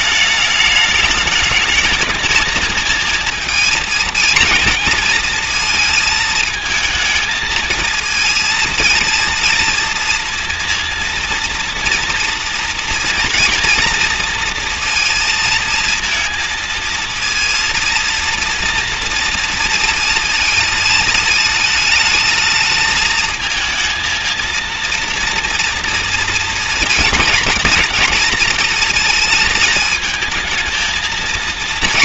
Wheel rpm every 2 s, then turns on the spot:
210, 220, 230, 220, 230, 230, 230, 230, 230, 230, 230, 220, 230, 230, 230, 220.
none